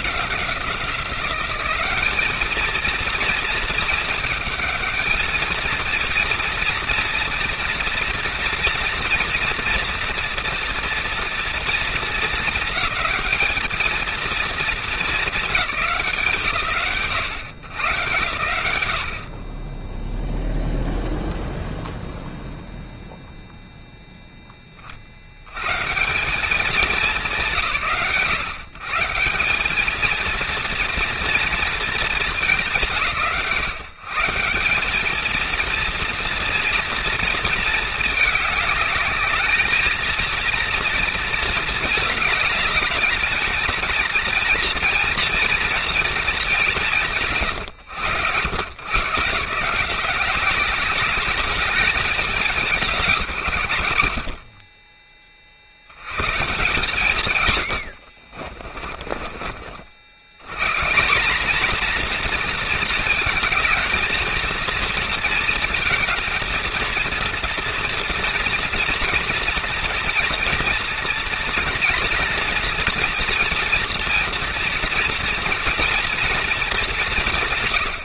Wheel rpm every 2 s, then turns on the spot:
210, 220, 230, 230, 240, 230, 230, 150, 100, 0, 0, 0, 140, 120, 220, 230, 140, 230, 220, 220, 220, 220, 230, 120, 160, 200, 110, 70, 90, 50, 230, 220, 220, 230, 240, 240, 230, 230, 140.
none